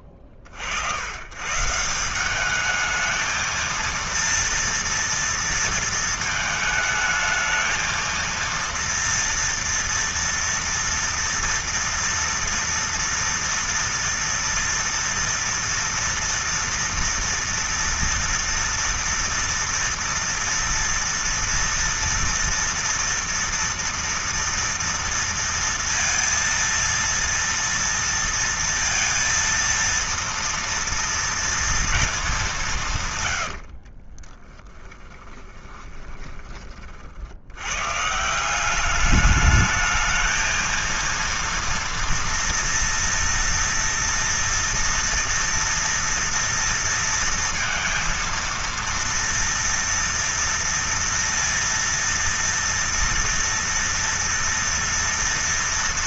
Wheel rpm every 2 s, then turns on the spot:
50, 200, 230, 220, 230, 230, 230, 230, 230, 230, 230, 230, 230, 230, 230, 230, 180, 10, 30, 190, 230, 230, 230, 230, 230, 230, 230, 230.
34-36